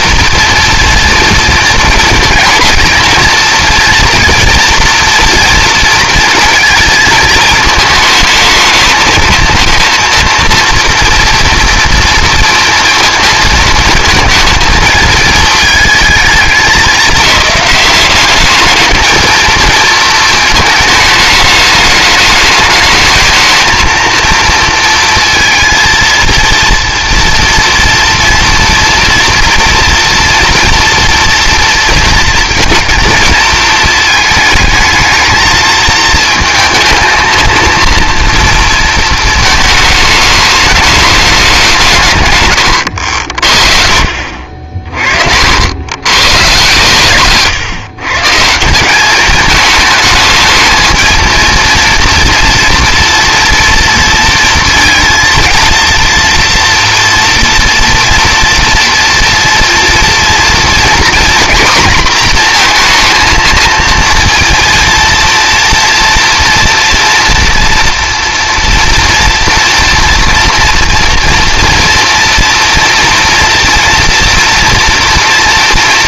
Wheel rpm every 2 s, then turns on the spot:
230, 230, 240, 230, 220, 230, 230, 230, 200, 210, 220, 210, 230, 230, 230, 240, 230, 220, 220, 230, 210, 110, 50, 130, 160, 220, 230, 230, 230, 240, 230, 230, 230, 230, 230, 230, 230, 230.
44-46